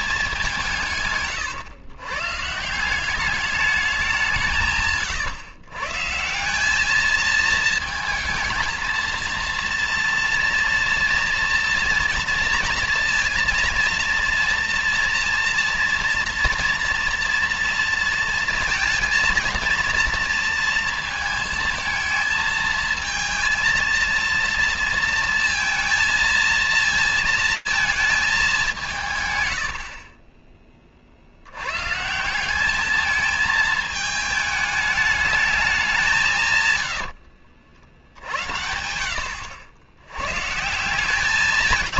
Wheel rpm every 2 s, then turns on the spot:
170, 150, 170, 180, 230, 230, 230, 230, 230, 230, 230, 220, 230, 230, 200, 20, 200, 210, 140, 80, 120.
none